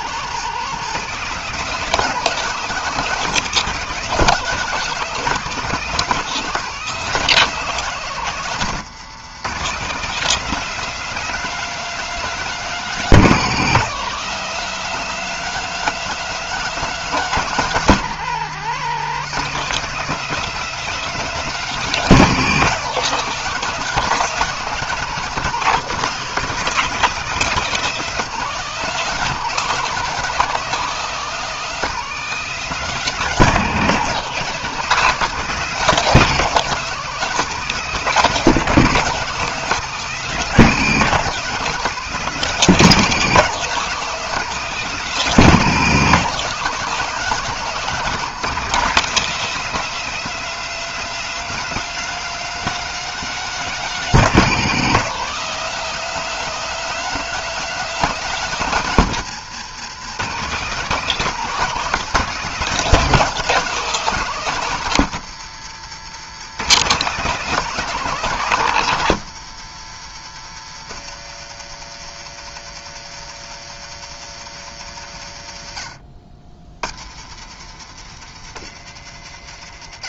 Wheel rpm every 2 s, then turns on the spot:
190, 200, 190, 190, 170, 210, 190, 210, 200, 190, 210, 200, 180, 190, 200, 200, 200, 200, 200, 190, 200, 190, 190, 200, 200, 210, 210, 190, 210, 160, 190, 200, 140, 180, 140, 120, 120, 80, 90, 120.
none